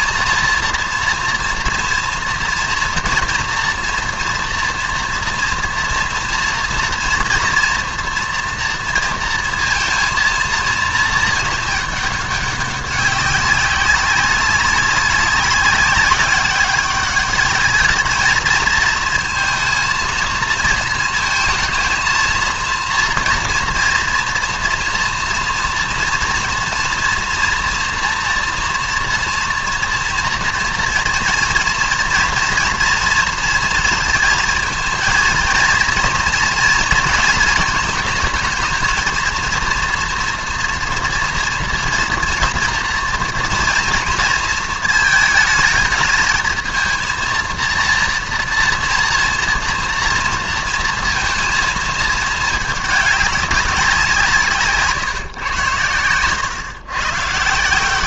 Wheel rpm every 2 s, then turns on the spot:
230, 230, 230, 230, 240, 230, 200, 200, 200, 220, 220, 230, 230, 240, 240, 230, 230, 230, 230, 220, 240, 240, 220, 220, 230, 230, 210, 160, 130.
54-56